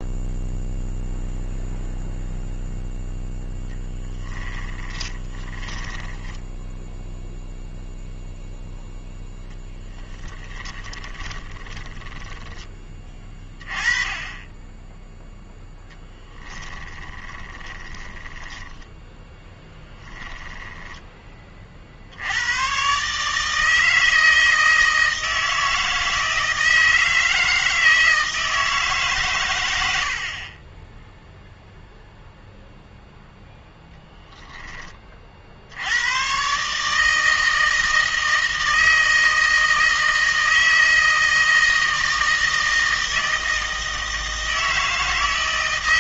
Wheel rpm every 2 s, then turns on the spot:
0, 0, 20, 10, 0, 20, 20, 10, 20, 10, 10, 120, 160, 160, 160, 20, 0, 10, 150, 160, 160, 160, 160.
4-8 10-12 16-22